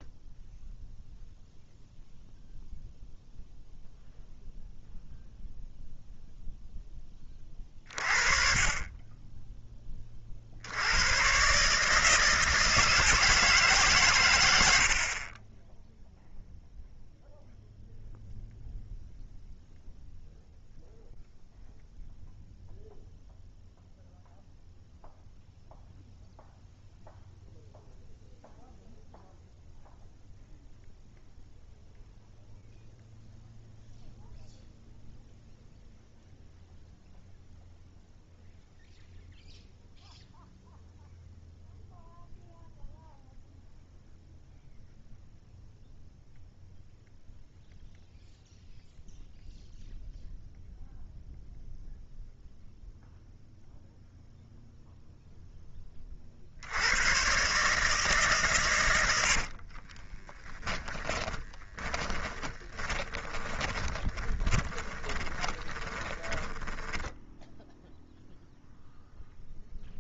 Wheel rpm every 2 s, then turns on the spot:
0, 0, 0, 0, 30, 70, 160, 80, 0, 0, 0, 0, 0, 0, 0, 0, 0, 0, 0, 0, 0, 0, 0, 0, 0, 0, 0, 0, 70, 130, 20, 20, 20, 10, 0.
60-68